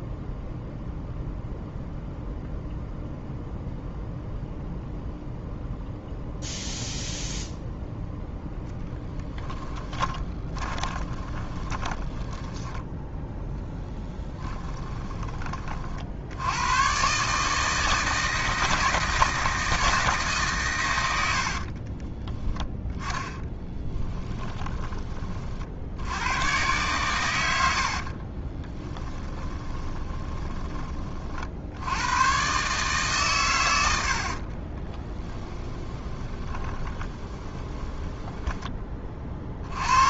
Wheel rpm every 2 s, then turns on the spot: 0, 0, 0, 0, 10, 20, 10, 20, 120, 160, 110, 20, 20, 120, 20, 30, 140, 20, 20, 20.
8-14 22-24 28-30 34-38